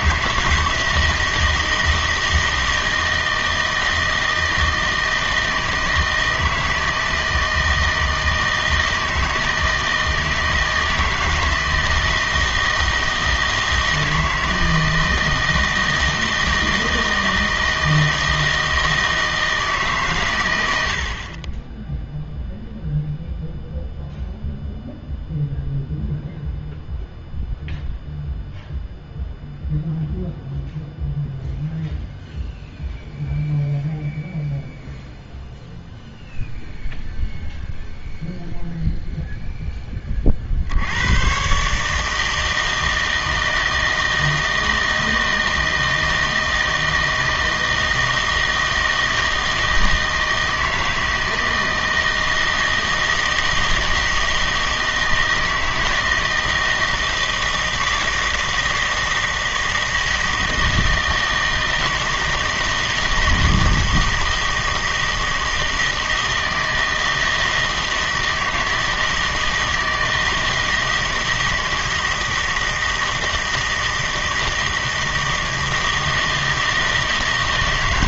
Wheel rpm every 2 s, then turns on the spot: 160, 160, 160, 160, 160, 160, 160, 160, 160, 160, 100, 0, 0, 0, 0, 0, 0, 0, 0, 0, 60, 160, 160, 160, 160, 160, 160, 160, 160, 160, 160, 160, 160, 160, 160, 160, 160, 160, 160.
none